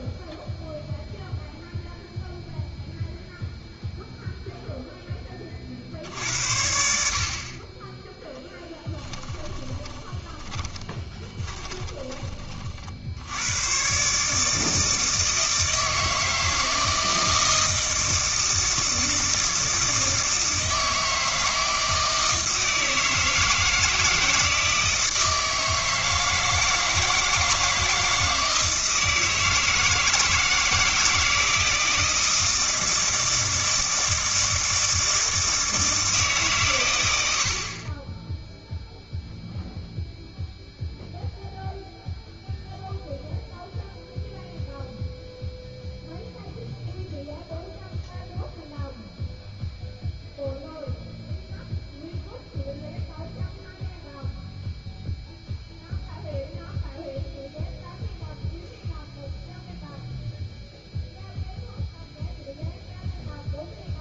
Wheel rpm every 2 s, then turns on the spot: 0, 0, 0, 60, 20, 20, 40, 160, 160, 160, 160, 160, 160, 160, 160, 160, 160, 160, 130, 0, 0, 0, 0, 0, 0, 0, 0, 0, 0, 0, 0, 0.
8-12